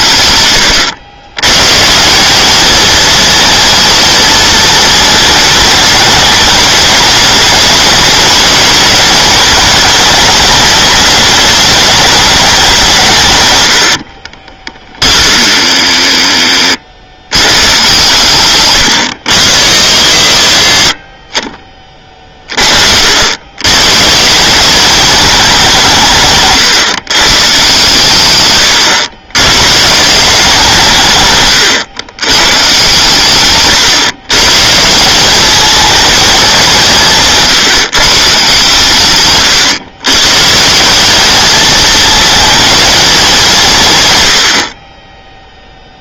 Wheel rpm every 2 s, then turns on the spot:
110, 220, 230, 210, 210, 210, 190, 30, 40, 140, 120, 40, 190, 130, 110, 160, 130, 150, 180, 140, 160, 220, 60.
14-16 28-30